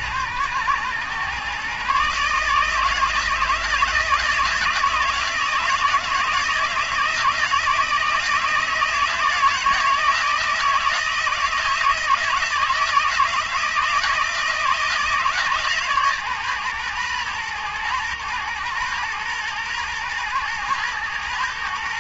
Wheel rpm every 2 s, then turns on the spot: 120, 160, 160, 160, 160, 160, 160, 160, 120, 120, 110.
none